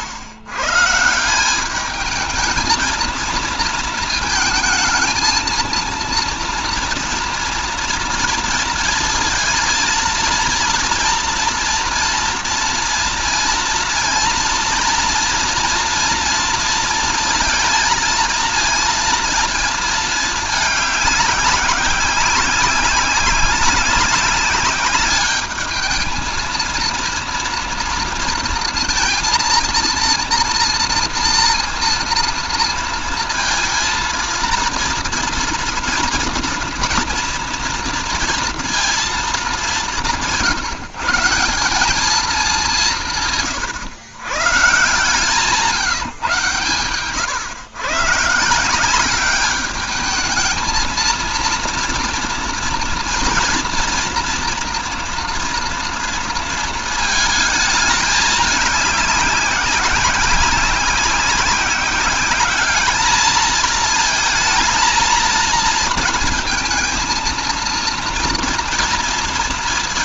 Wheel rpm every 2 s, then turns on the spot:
130, 220, 220, 230, 230, 230, 230, 230, 230, 230, 210, 190, 200, 230, 230, 230, 230, 230, 230, 230, 160, 190, 130, 130, 170, 220, 230, 230, 220, 200, 190, 210, 220, 230, 230.
none